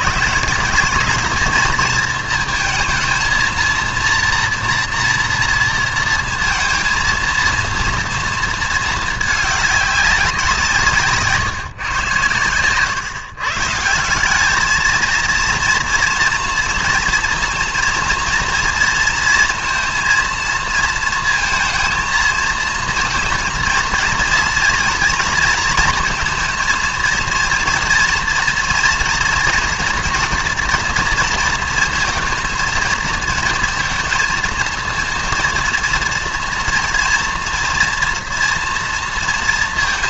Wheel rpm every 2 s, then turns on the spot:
200, 230, 230, 230, 220, 160, 120, 210, 230, 240, 230, 230, 240, 230, 230, 240, 230, 230, 230, 230.
none